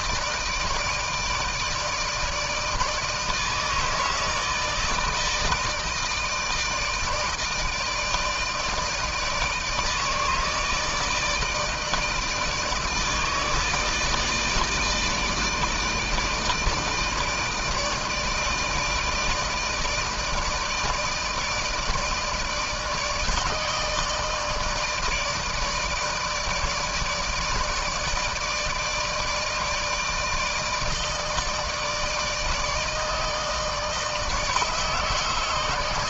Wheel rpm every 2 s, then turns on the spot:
160, 160, 160, 160, 160, 160, 150, 160, 160, 160, 160, 160, 160, 160, 160, 160, 160, 160.
none